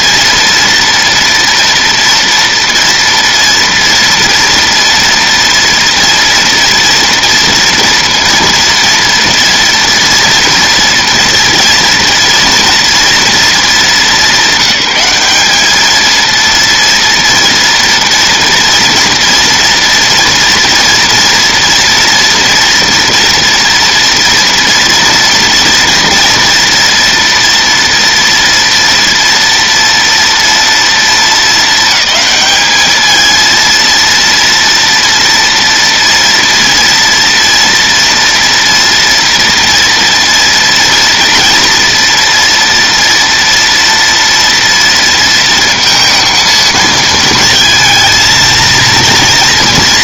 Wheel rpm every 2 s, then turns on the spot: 230, 230, 230, 230, 230, 230, 230, 190, 230, 230, 230, 230, 230, 230, 230, 220, 210, 230, 230, 230, 230, 230, 230, 220, 230.
none